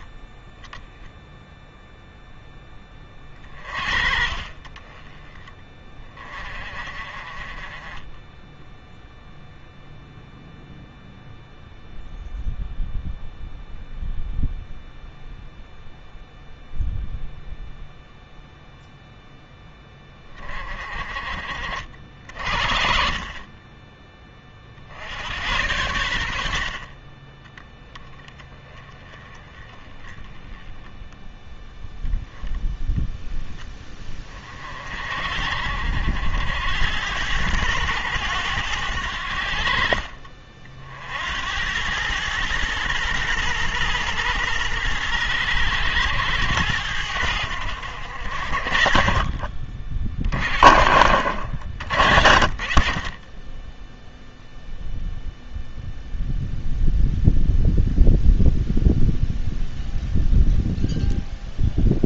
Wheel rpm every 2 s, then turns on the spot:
10, 10, 30, 40, 0, 0, 0, 0, 0, 0, 30, 40, 50, 50, 20, 10, 0, 40, 90, 90, 50, 110, 110, 100, 50, 60, 50, 0, 0, 0, 0.
none